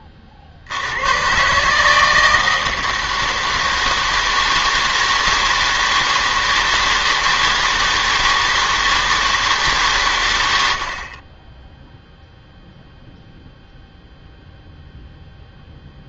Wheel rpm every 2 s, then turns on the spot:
70, 160, 160, 160, 160, 100, 0, 0.
none